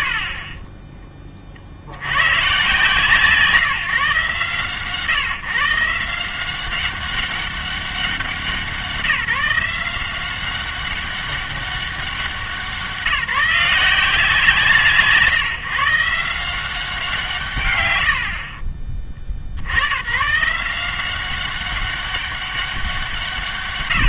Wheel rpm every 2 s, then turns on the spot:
40, 140, 140, 190, 180, 190, 180, 160, 170, 20, 160, 190.
0-2 18-20